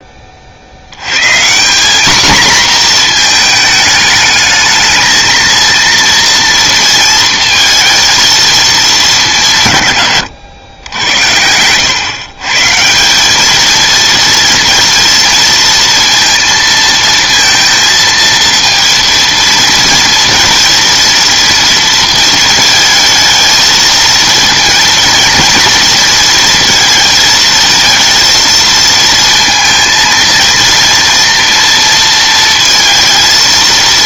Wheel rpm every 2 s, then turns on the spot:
50, 240, 220, 230, 220, 100, 150, 230, 230, 230, 230, 220, 230, 230, 230, 230, 230.
none